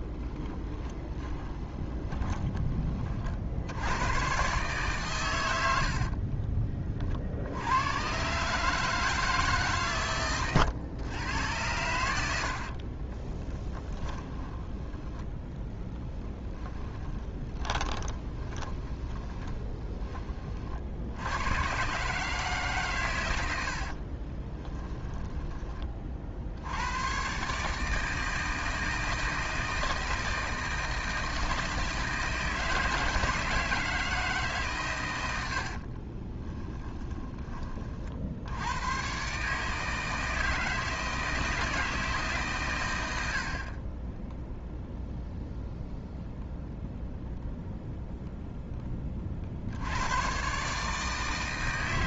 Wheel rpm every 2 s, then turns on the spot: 20, 30, 140, 50, 150, 110, 30, 10, 20, 20, 60, 140, 10, 100, 160, 160, 160, 130, 10, 100, 160, 110, 0, 0, 10, 150.
0-2 12-14 16-20 24-26 36-38